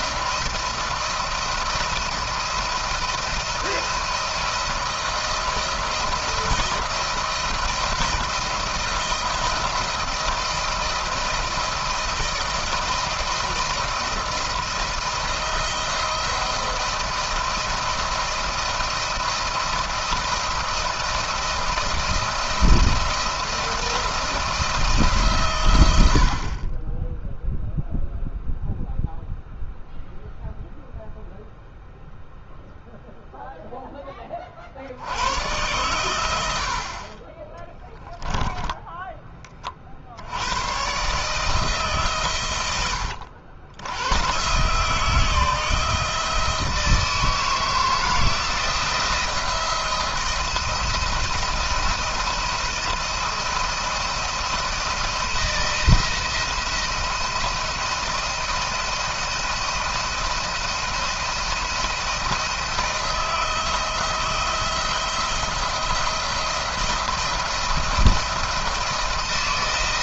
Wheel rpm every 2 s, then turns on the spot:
170, 170, 170, 170, 170, 170, 160, 170, 170, 170, 170, 170, 170, 30, 0, 0, 0, 40, 70, 10, 90, 120, 120, 160, 160, 170, 170, 170, 170, 170, 170, 170, 170, 170, 170.
38-40